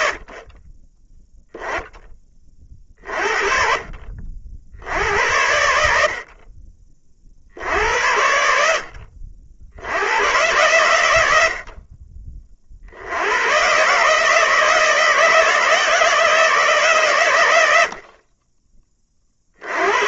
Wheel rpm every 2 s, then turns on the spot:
30, 30, 80, 40, 70, 110, 50, 160, 150, 30.
none